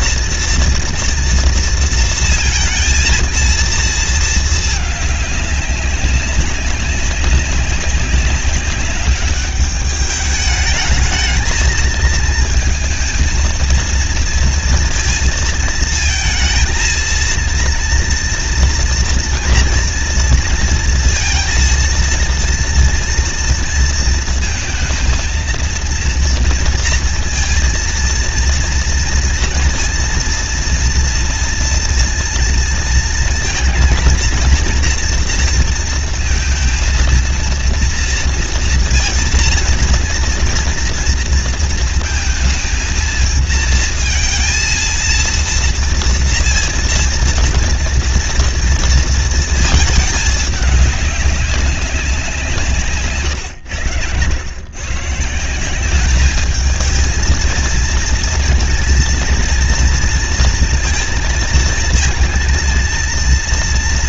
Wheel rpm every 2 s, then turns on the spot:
230, 230, 220, 190, 200, 210, 220, 230, 230, 240, 230, 230, 230, 230, 230, 230, 230, 230, 230, 230, 230, 230, 230, 230, 230, 210, 180, 110, 210, 230, 230, 230.
none